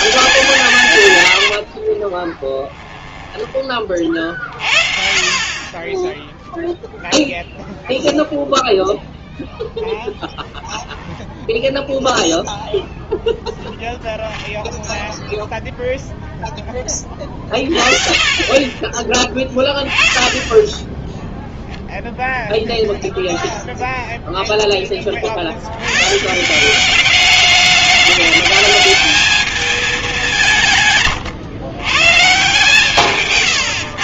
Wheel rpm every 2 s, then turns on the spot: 150, 20, 40, 0, 0, 10, 0, 0, 10, 20, 10, 0, 20, 190, 210, 150, 140.
2-4 30-32